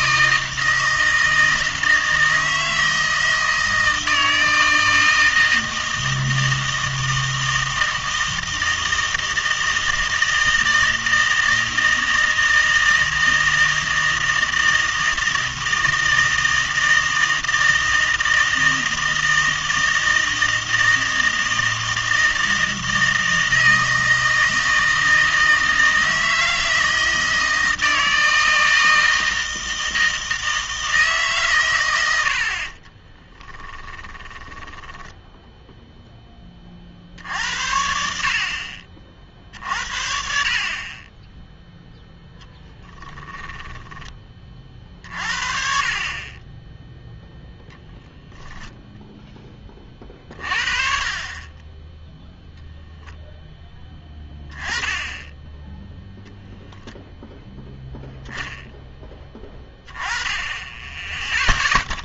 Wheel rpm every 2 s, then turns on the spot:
160, 160, 160, 160, 160, 160, 160, 160, 160, 160, 160, 160, 160, 160, 160, 160, 40, 10, 40, 50, 40, 10, 40, 10, 10, 40, 0, 10, 0, 10, 20.
32-36 42-44